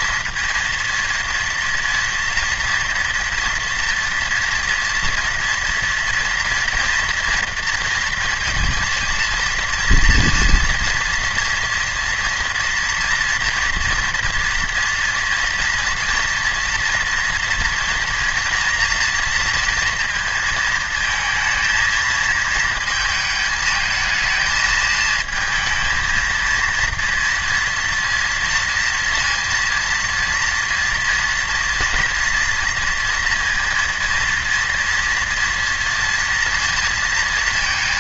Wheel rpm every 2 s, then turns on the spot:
230, 230, 230, 240, 230, 230, 230, 230, 230, 230, 230, 230, 220, 230, 230, 230, 230, 230, 230.
none